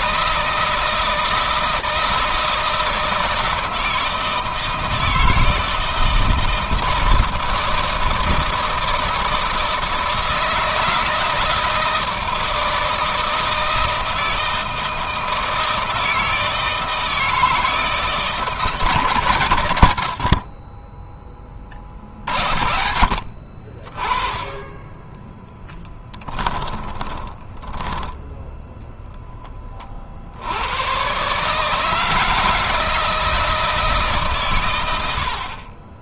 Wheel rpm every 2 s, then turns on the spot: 160, 160, 160, 160, 160, 160, 160, 160, 160, 150, 40, 60, 20, 20, 10, 110, 160, 110.
26-28